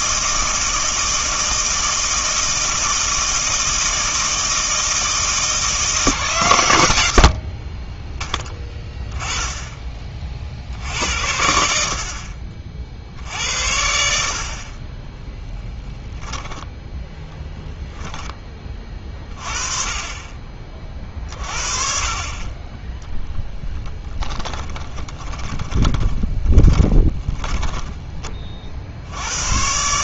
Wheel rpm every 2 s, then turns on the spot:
160, 160, 160, 130, 10, 70, 50, 30, 0, 20, 40, 20, 20, 20, 50.
24-28